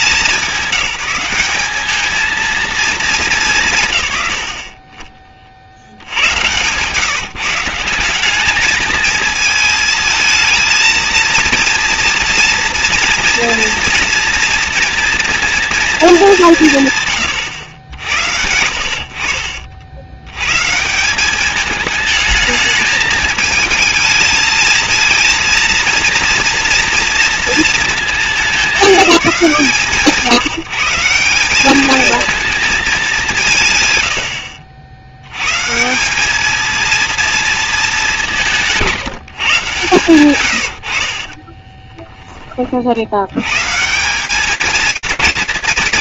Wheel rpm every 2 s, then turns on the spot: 200, 230, 50, 140, 210, 220, 230, 230, 150, 60, 150, 220, 220, 230, 210, 150, 220, 60, 220, 170, 100, 50, 220.
38-42